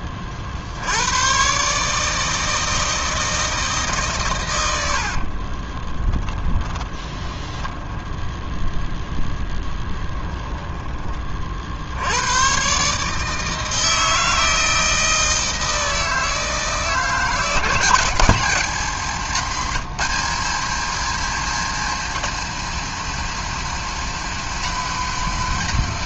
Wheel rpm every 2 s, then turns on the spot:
70, 160, 90, 20, 0, 20, 140, 160, 160, 200, 210, 230, 230.
4-8